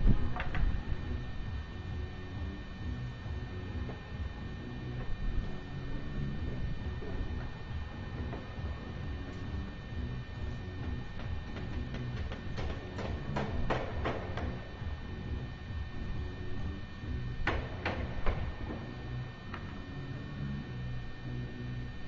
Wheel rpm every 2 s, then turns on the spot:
0, 0, 0, 0, 0, 0, 0, 0, 0, 0, 0.
none